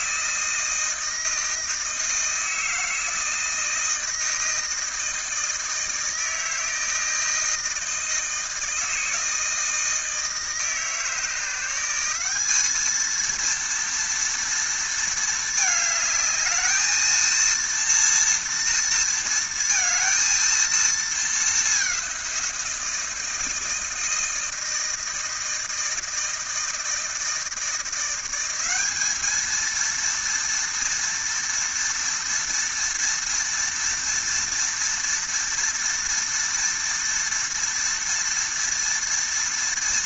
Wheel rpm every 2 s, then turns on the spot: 160, 160, 160, 160, 160, 160, 210, 230, 220, 230, 230, 170, 160, 160, 200, 230, 230, 230, 230, 230.
none